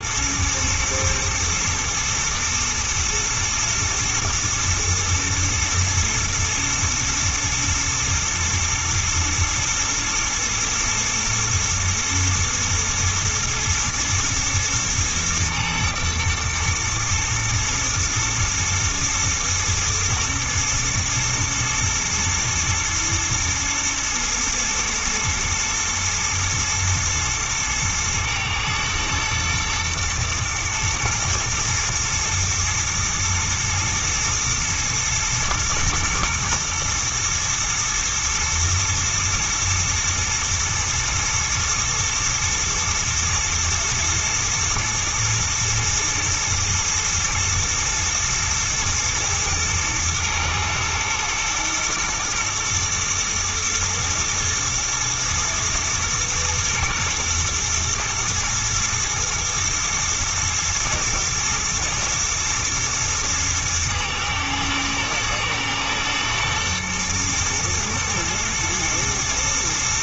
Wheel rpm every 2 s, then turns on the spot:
120, 110, 110, 120, 110, 110, 110, 110, 110, 110, 110, 110, 110, 110, 110, 120, 120, 110, 110, 110, 110, 110, 120, 110, 120, 120, 120, 110, 110, 110, 120, 120, 110, 120, 110.
none